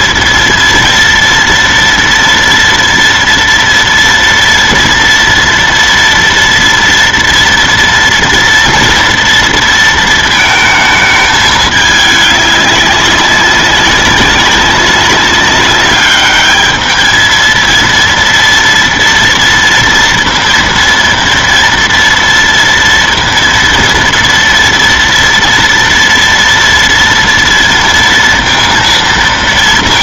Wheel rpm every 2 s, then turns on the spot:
230, 230, 230, 230, 230, 220, 200, 190, 210, 230, 230, 230, 230, 230, 230.
none